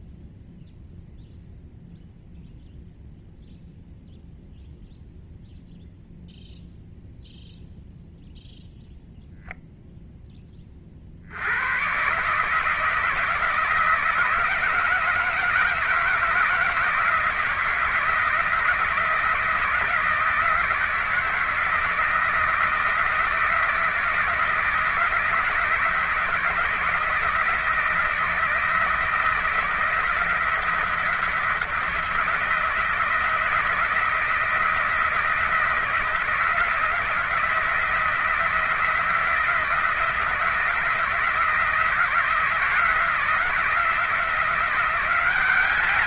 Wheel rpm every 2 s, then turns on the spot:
0, 0, 0, 0, 0, 30, 160, 160, 160, 170, 170, 170, 160, 170, 160, 170, 170, 160, 160, 160, 160, 170, 180.
none